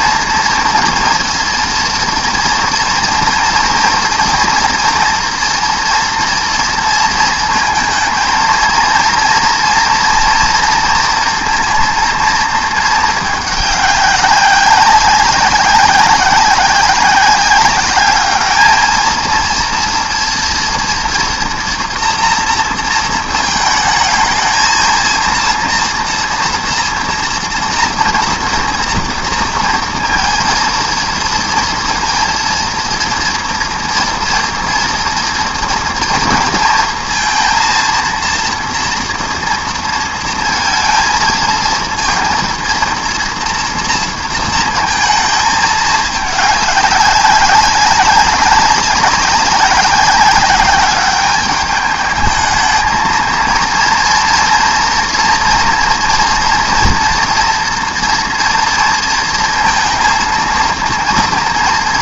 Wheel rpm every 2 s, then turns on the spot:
230, 240, 240, 230, 220, 230, 220, 190, 190, 220, 230, 230, 230, 230, 230, 230, 230, 230, 230, 230, 230, 230, 230, 210, 190, 200, 220, 240, 240, 230, 230.
none